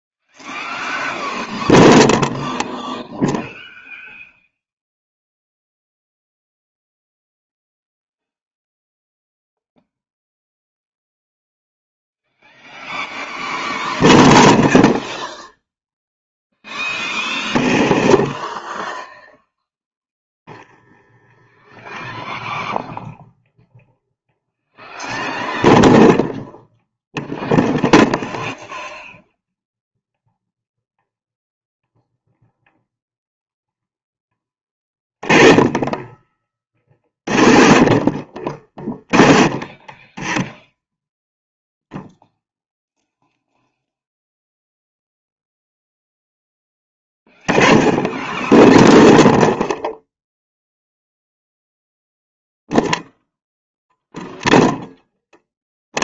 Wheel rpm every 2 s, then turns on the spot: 0, 0, 0, 0, 0, 0, 0, 0, 10, 10, 10, 0, 0, 10, 0, 0, 10, 30, 40, 50, 10, 0, 0, 0, 0, 0, 0, 0.
18-20 34-40